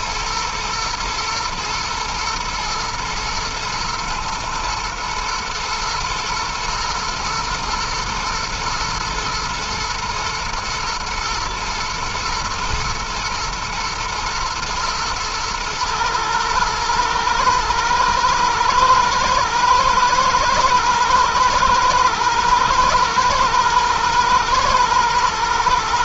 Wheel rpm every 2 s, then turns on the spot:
110, 110, 120, 120, 120, 110, 110, 110, 110, 110, 110, 120, 110.
none